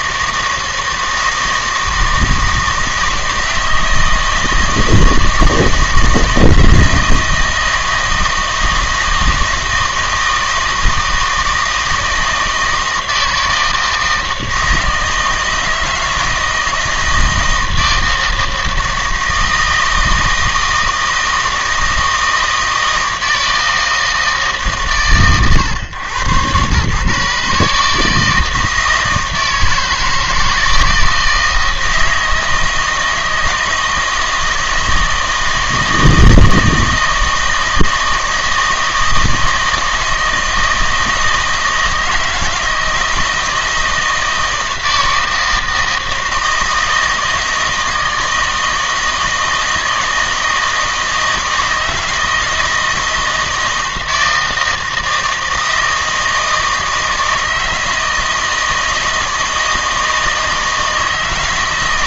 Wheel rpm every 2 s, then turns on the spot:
160, 160, 160, 160, 160, 160, 160, 160, 160, 160, 160, 160, 140, 130, 160, 160, 160, 160, 160, 160, 160, 160, 160, 160, 160, 160, 160, 160, 160, 160, 160.
none